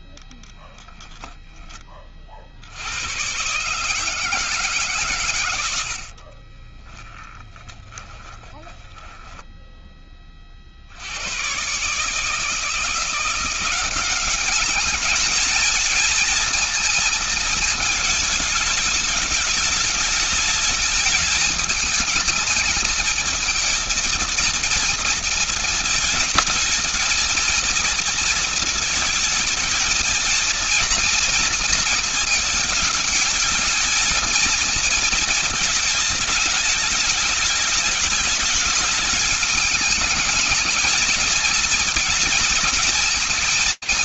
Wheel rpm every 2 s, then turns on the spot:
10, 80, 140, 20, 10, 50, 160, 200, 220, 210, 210, 220, 230, 220, 220, 220, 210, 220, 210, 220, 220, 220.
0-2 6-10